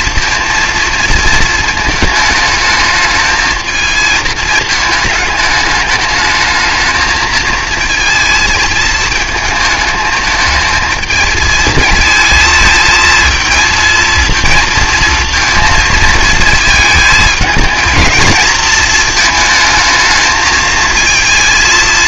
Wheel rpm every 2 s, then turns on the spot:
230, 220, 220, 220, 220, 220, 220, 220, 220, 220, 220.
none